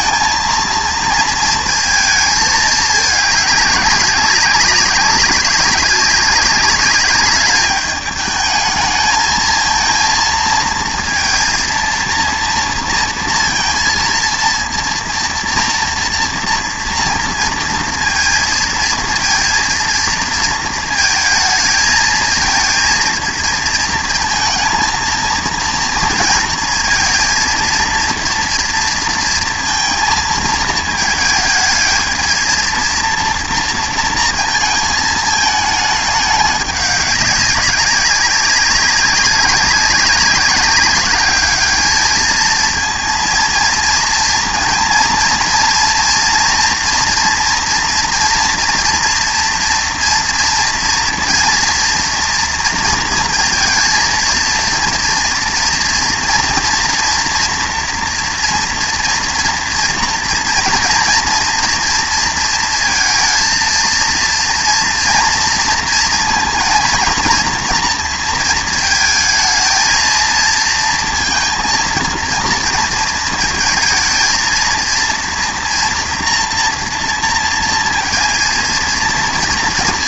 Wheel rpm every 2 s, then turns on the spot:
220, 210, 190, 200, 210, 230, 230, 230, 230, 230, 220, 230, 230, 230, 230, 220, 220, 220, 200, 190, 200, 220, 230, 230, 230, 230, 230, 230, 230, 230, 240, 230, 230, 230, 230, 230, 230, 230, 230, 230.
none